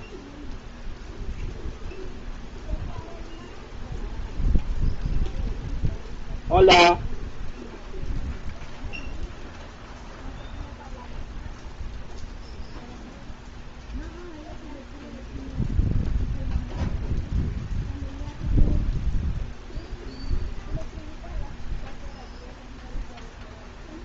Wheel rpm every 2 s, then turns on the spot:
0, 0, 0, 0, 0, 0, 0, 0, 0, 0, 0, 0.
none